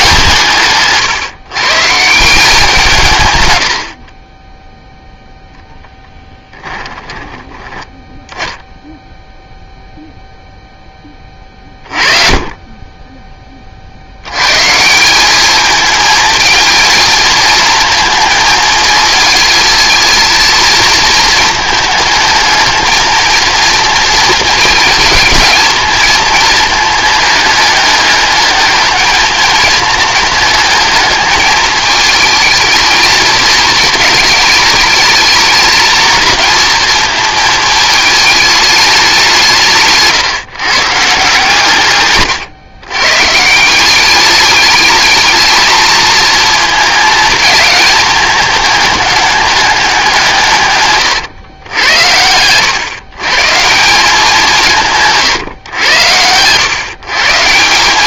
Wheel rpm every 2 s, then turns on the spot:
140, 170, 10, 10, 10, 10, 20, 160, 220, 220, 220, 220, 220, 220, 210, 210, 220, 210, 220, 210, 150, 130, 210, 220, 210, 140, 110, 170, 130.
6-8